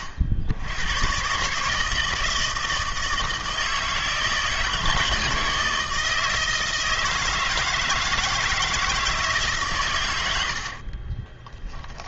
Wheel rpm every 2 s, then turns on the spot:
80, 160, 160, 160, 160, 60.
10-12